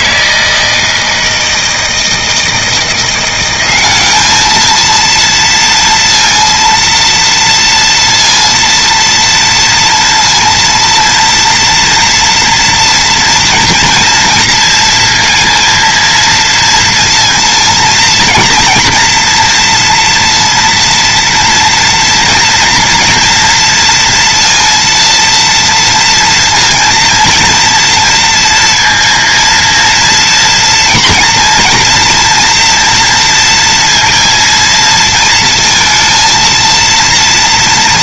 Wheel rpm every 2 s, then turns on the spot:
160, 170, 230, 230, 230, 230, 230, 230, 230, 230, 230, 230, 230, 230, 230, 230, 230, 230, 230.
none